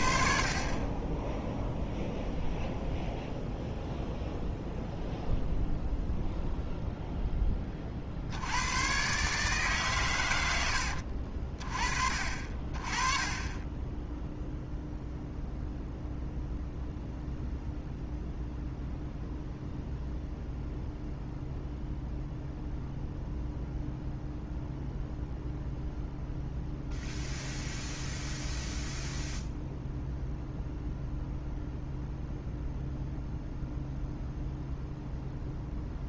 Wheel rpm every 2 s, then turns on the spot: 30, 0, 0, 0, 100, 80, 40, 0, 0, 0, 0, 0, 0, 0, 0, 0, 0, 0.
none